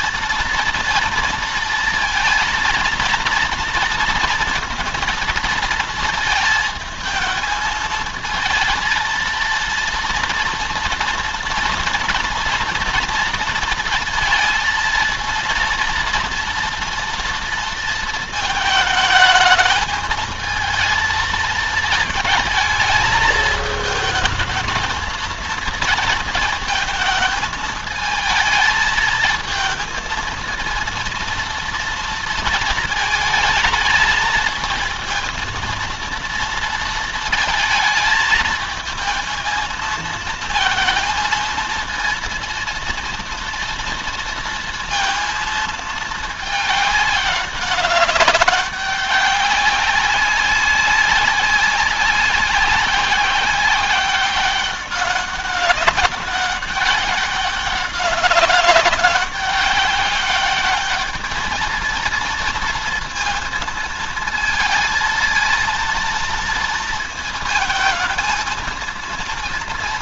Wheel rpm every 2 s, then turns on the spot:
230, 230, 230, 220, 220, 230, 230, 230, 230, 220, 220, 220, 220, 220, 220, 230, 230, 220, 230, 220, 230, 230, 230, 210, 200, 190, 190, 190, 200, 200, 210, 230, 220, 230, 220.
none